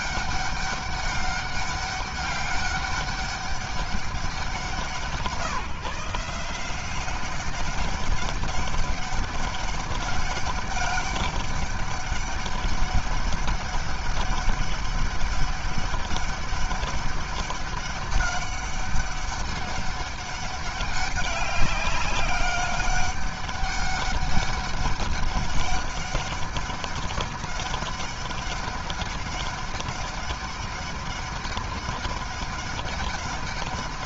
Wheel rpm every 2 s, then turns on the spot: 200, 200, 180, 160, 200, 200, 200, 200, 200, 200, 200, 200, 200, 200, 200, 200, 200.
none